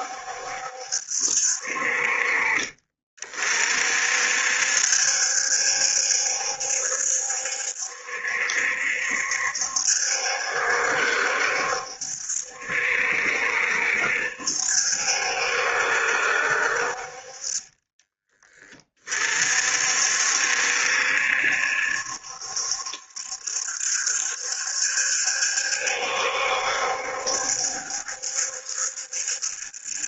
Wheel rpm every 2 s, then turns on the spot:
70, 40, 70, 70, 70, 70, 70, 70, 50, 30, 70, 70, 70, 70, 70.
none